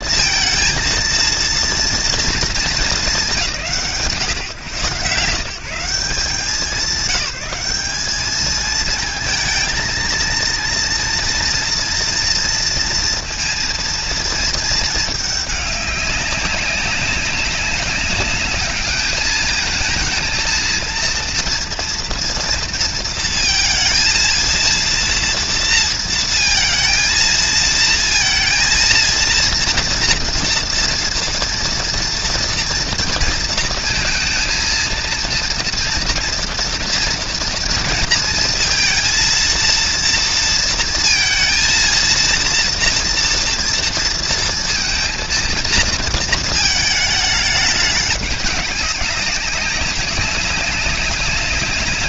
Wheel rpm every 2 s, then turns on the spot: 230, 220, 140, 180, 220, 230, 230, 230, 190, 210, 230, 230, 230, 230, 230, 230, 230, 230, 230, 230, 230, 230, 230, 220, 200, 190.
none